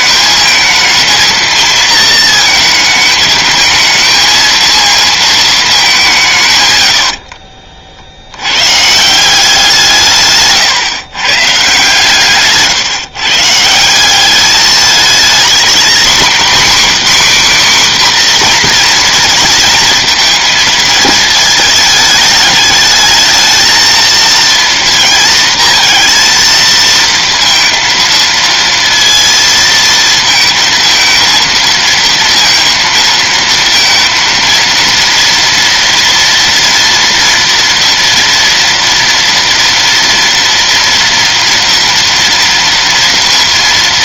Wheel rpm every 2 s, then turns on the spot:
220, 220, 230, 130, 110, 140, 140, 210, 270, 240, 220, 210, 230, 230, 230, 230, 230, 230, 230, 230, 230, 230.
none